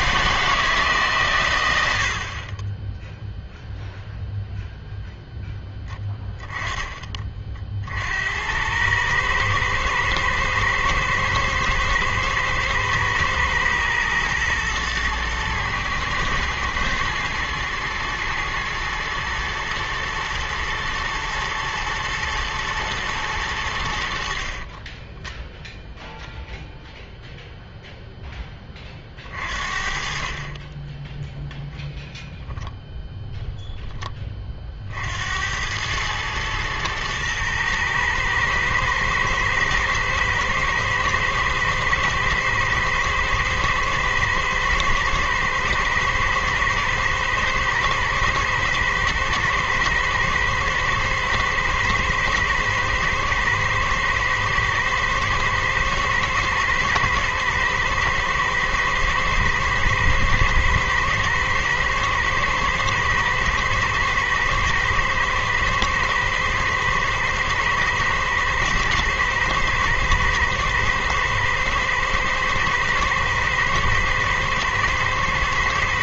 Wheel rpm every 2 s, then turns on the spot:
150, 10, 0, 20, 100, 110, 110, 120, 110, 110, 120, 110, 30, 10, 30, 20, 0, 50, 110, 110, 110, 110, 110, 110, 110, 110, 110, 110, 110, 120, 110, 110, 120, 110, 110, 110, 110, 110.
24-26